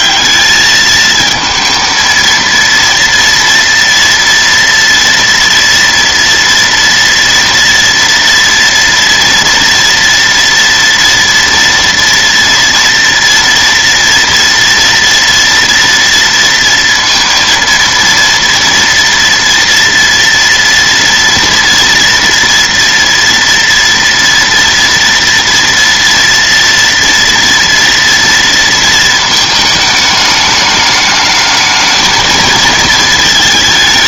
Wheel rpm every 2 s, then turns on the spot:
220, 230, 230, 230, 230, 230, 230, 230, 230, 230, 230, 230, 230, 230, 230, 210, 220.
none